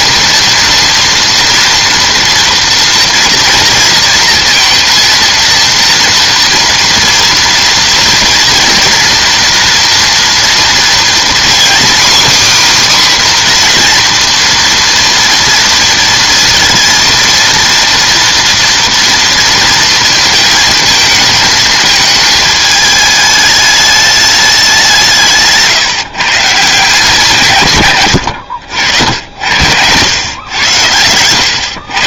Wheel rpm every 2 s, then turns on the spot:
230, 230, 230, 240, 230, 230, 280, 230, 230, 230, 220, 220, 190, 160, 70, 100.
none